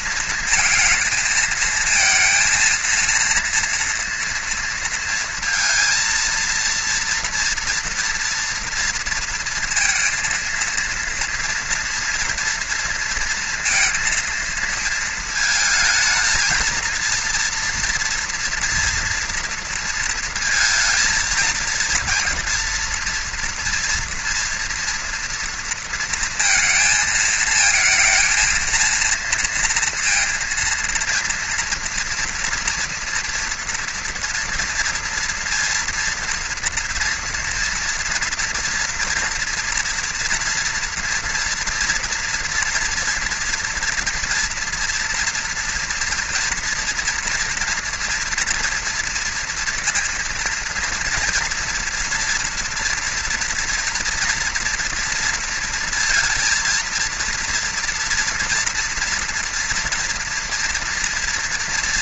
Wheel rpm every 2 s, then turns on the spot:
220, 230, 230, 230, 230, 230, 230, 220, 230, 230, 220, 240, 230, 230, 230, 230, 230, 230, 230, 230, 240, 240, 230, 230, 230, 230, 230, 230, 230, 230, 230.
none